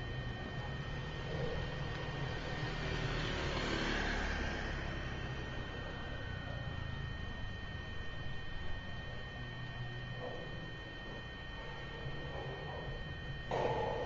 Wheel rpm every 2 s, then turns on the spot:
0, 0, 0, 0, 0, 0, 0.
none